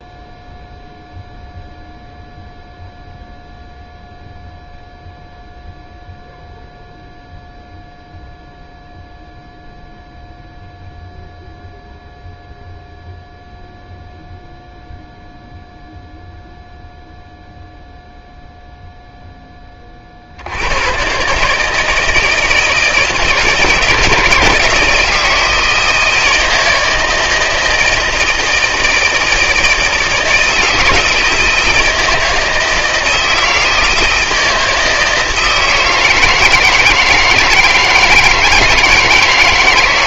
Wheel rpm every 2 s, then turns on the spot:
0, 0, 0, 0, 0, 0, 0, 0, 0, 0, 70, 160, 160, 160, 160, 160, 160, 160, 160, 160.
none